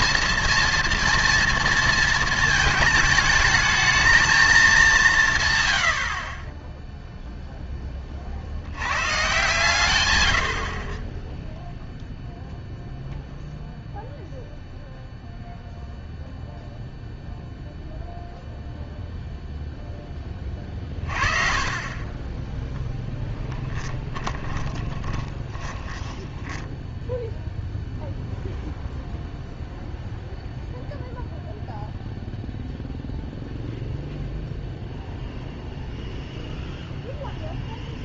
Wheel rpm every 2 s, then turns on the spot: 230, 220, 210, 20, 70, 70, 0, 0, 0, 0, 30, 10, 20, 10, 0, 0, 0, 0, 0.
24-28